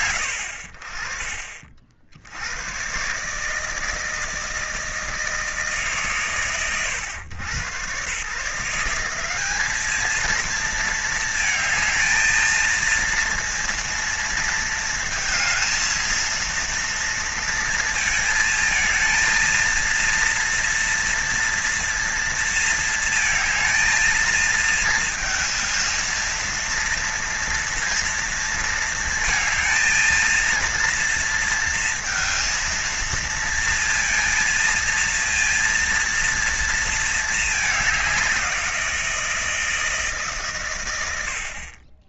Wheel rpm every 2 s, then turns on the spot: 90, 100, 160, 100, 170, 230, 230, 230, 230, 230, 230, 230, 220, 230, 230, 230, 220, 230, 230, 170, 120.
none